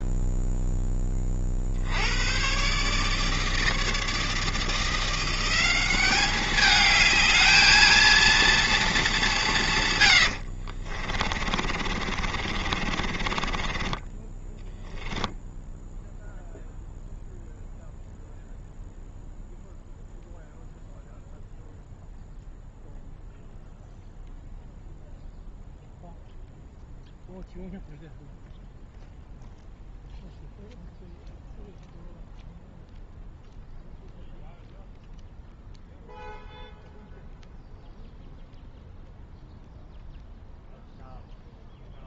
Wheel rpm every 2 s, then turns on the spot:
0, 120, 160, 200, 230, 70, 30, 10, 0, 0, 0, 0, 0, 0, 0, 0, 0, 0, 0, 0, 0.
10-16